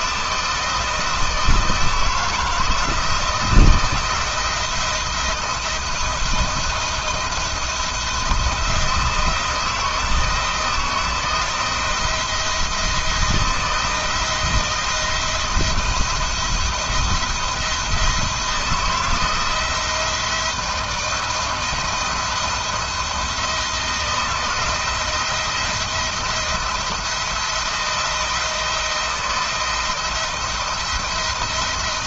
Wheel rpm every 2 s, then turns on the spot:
160, 160, 170, 170, 170, 170, 170, 170, 170, 170, 170, 170, 170, 170, 170, 170.
none